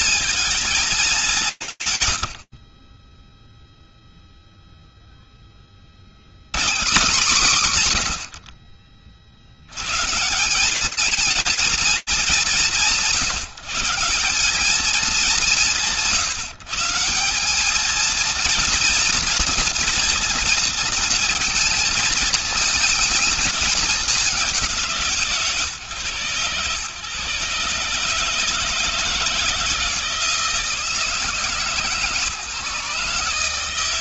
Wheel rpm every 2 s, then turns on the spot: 120, 0, 150, 70, 210, 180, 200, 160, 230, 230, 220, 180, 130, 160, 160, 150, 160.
none